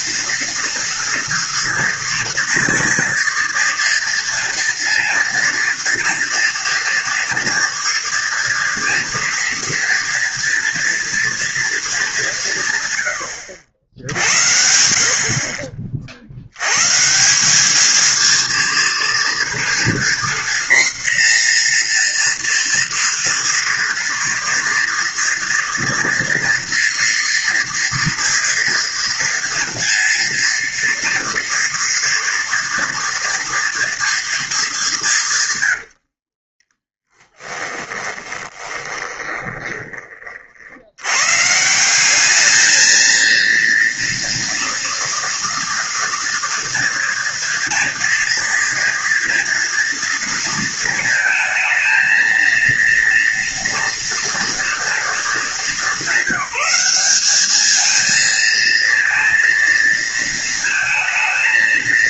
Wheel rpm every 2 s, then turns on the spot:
230, 230, 230, 230, 230, 230, 120, 60, 150, 230, 240, 230, 230, 230, 230, 230, 230, 180, 10, 20, 100, 220, 240, 240, 230, 220, 230, 220, 200, 230, 220.
36-40